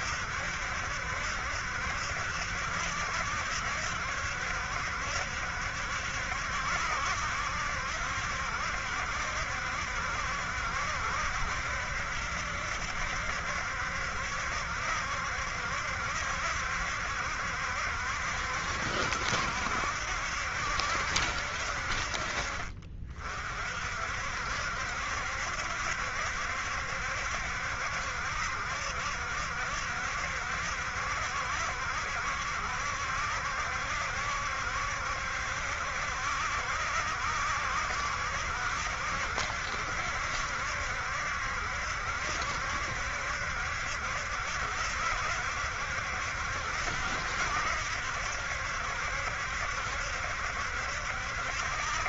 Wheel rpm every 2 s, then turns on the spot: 70, 70, 70, 70, 70, 70, 70, 70, 70, 70, 70, 40, 70, 70, 70, 70, 70, 70, 70, 70, 70, 70, 70, 70, 70, 70.
none